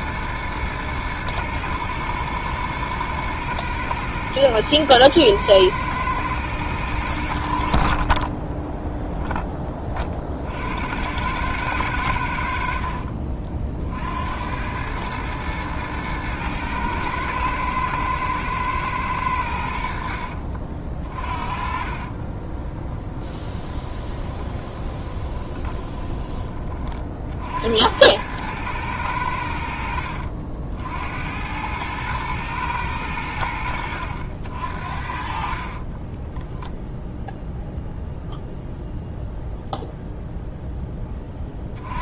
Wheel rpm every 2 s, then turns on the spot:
110, 120, 110, 110, 10, 60, 60, 100, 120, 120, 50, 10, 20, 20, 110, 60, 110, 60, 0, 0, 0.
8-10 12-14 20-26